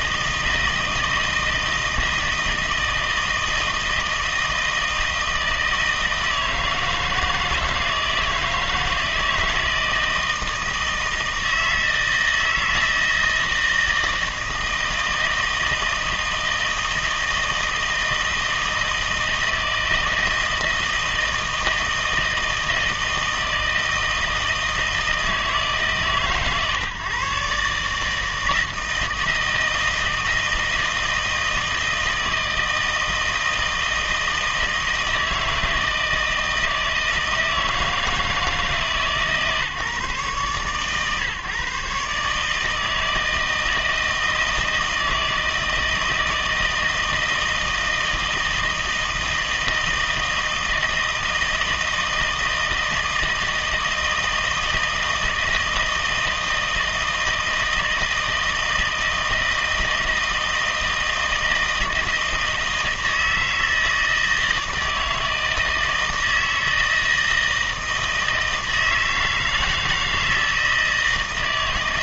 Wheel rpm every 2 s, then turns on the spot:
160, 160, 160, 160, 160, 160, 160, 160, 160, 160, 160, 160, 160, 140, 160, 160, 160, 160, 160, 160, 140, 150, 160, 160, 160, 160, 160, 160, 160, 160, 160, 160, 160, 160, 160, 160.
none